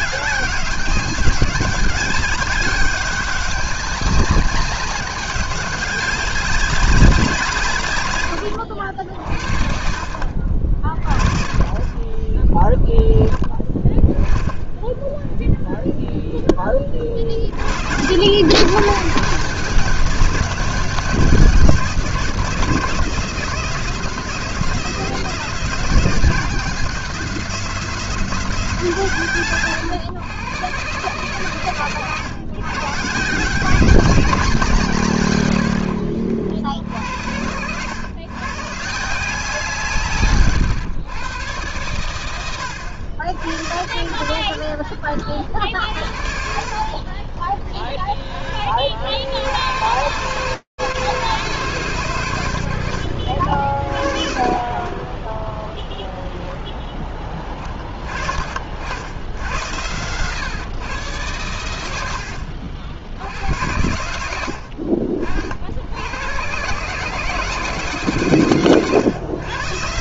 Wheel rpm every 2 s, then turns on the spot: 200, 200, 200, 180, 60, 50, 10, 10, 50, 160, 170, 170, 180, 180, 150, 130, 140, 150, 80, 170, 110, 80, 70, 50, 80, 160, 70, 20, 10, 80, 110, 90, 60, 160, 120.
none